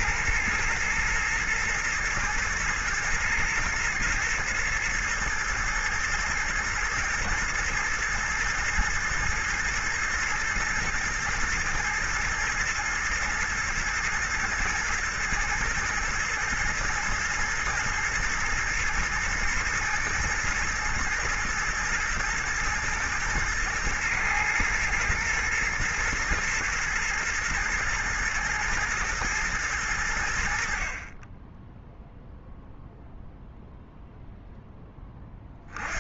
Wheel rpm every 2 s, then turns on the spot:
120, 110, 110, 110, 120, 120, 110, 110, 110, 110, 120, 110, 110, 120, 120, 40, 0, 10.
none